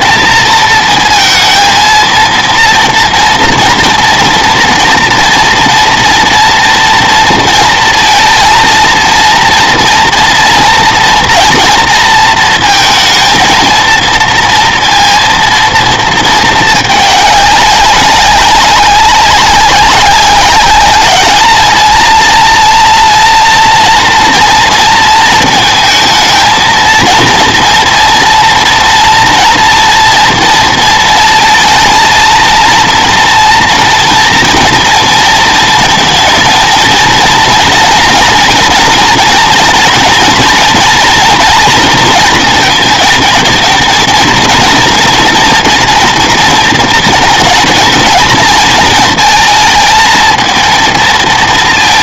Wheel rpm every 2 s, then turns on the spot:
220, 230, 230, 230, 230, 240, 230, 230, 220, 200, 200, 230, 230, 230, 230, 230, 230, 230, 230, 230, 230, 230, 240, 230, 220, 230.
none